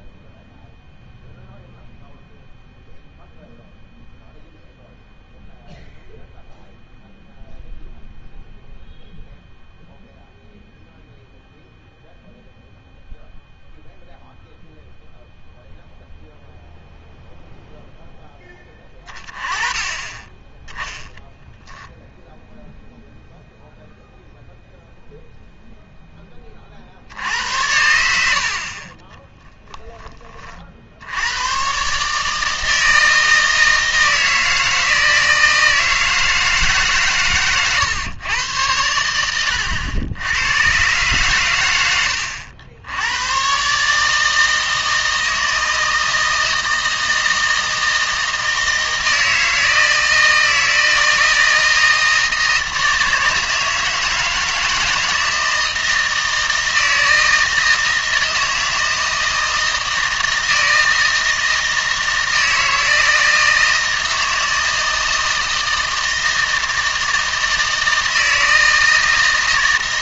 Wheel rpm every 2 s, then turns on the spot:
0, 0, 0, 0, 0, 0, 0, 0, 0, 20, 20, 0, 0, 50, 60, 50, 160, 160, 150, 110, 110, 80, 160, 160, 160, 160, 160, 160, 160, 160, 160, 160, 160, 160, 160.
none